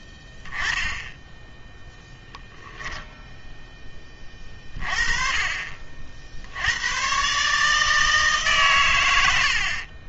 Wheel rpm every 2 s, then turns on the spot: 10, 0, 30, 80, 130.
none